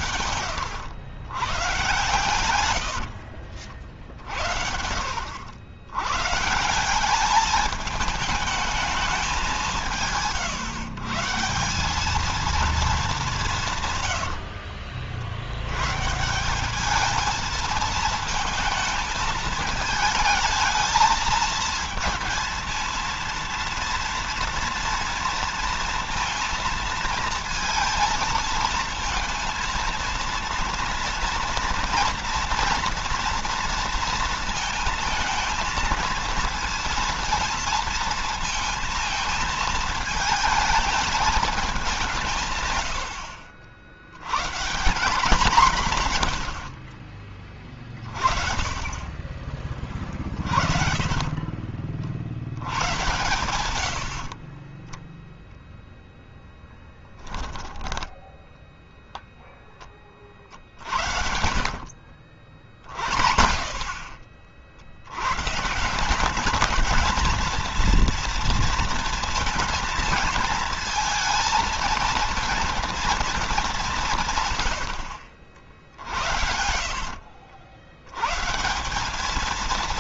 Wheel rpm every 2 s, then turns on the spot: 100, 70, 70, 180, 210, 150, 210, 60, 210, 220, 220, 230, 230, 230, 230, 230, 230, 220, 230, 230, 220, 100, 180, 50, 30, 40, 110, 10, 10, 0, 60, 30, 80, 220, 230, 230, 230, 100, 70, 190.
2-4 46-48 60-62 74-78